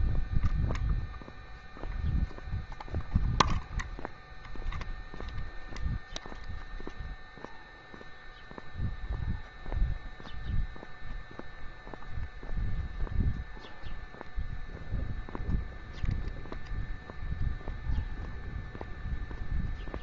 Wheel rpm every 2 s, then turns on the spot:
0, 0, 0, 0, 0, 0, 0, 0, 0, 0.
none